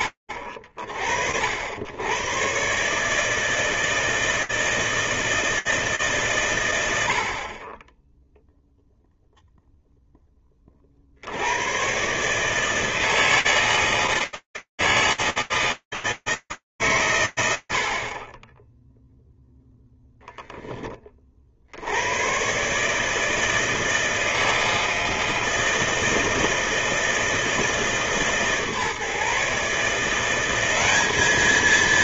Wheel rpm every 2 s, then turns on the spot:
60, 130, 160, 90, 0, 70, 160, 160, 130, 0, 50, 160, 160, 160, 150, 220.
none